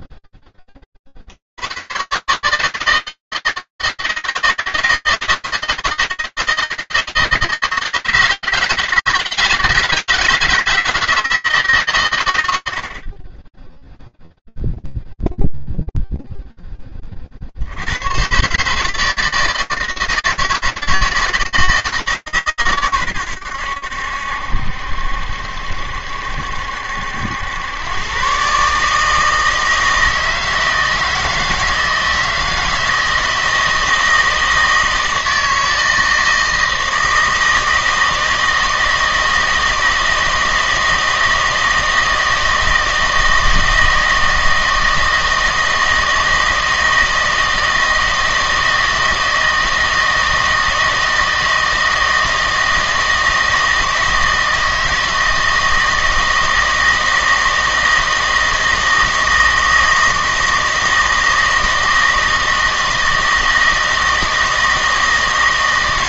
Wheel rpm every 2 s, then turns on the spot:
10, 140, 160, 160, 160, 160, 100, 0, 0, 130, 160, 140, 70, 70, 130, 160, 160, 160, 160, 160, 160, 160, 160, 160, 160, 160, 160, 160, 160, 160, 160, 160, 160.
none